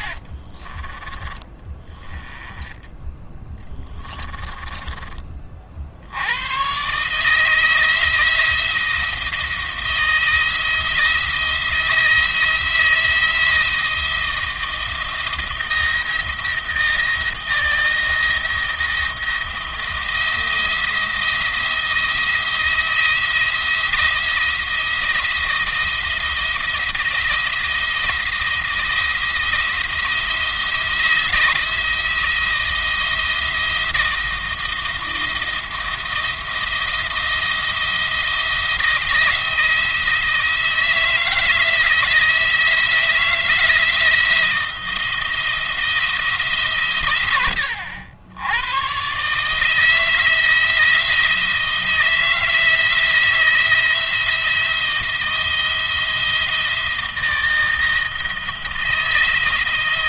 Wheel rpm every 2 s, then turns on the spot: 20, 10, 20, 140, 160, 170, 160, 170, 170, 170, 170, 170, 170, 170, 160, 170, 170, 170, 170, 170, 160, 170, 170, 120, 130, 160, 170, 170, 160, 160.
2-4